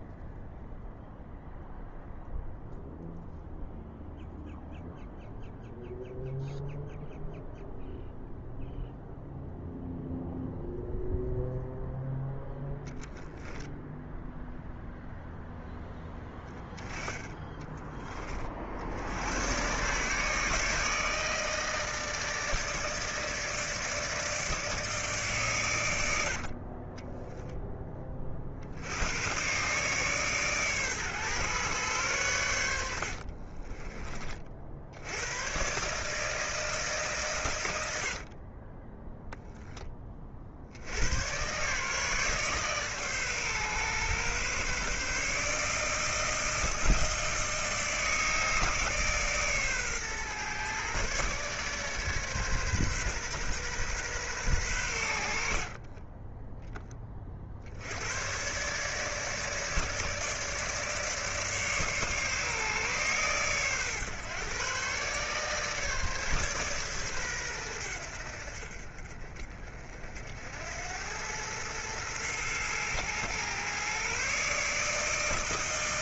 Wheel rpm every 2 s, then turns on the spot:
0, 0, 0, 0, 0, 0, 0, 0, 10, 60, 150, 160, 150, 30, 80, 130, 70, 70, 150, 10, 80, 140, 140, 160, 150, 130, 130, 110, 20, 140, 150, 140, 130, 130, 50, 90, 120, 150.
26-28 32-34 38-40